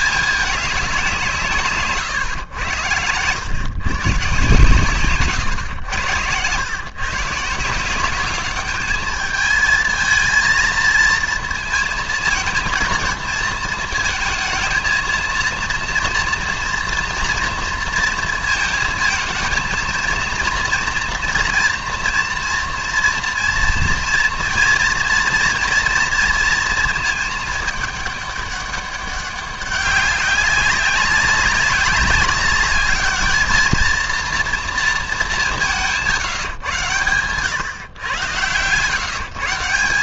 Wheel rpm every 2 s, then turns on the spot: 200, 110, 140, 120, 210, 230, 230, 230, 230, 220, 230, 230, 240, 230, 200, 200, 210, 230, 140, 120.
none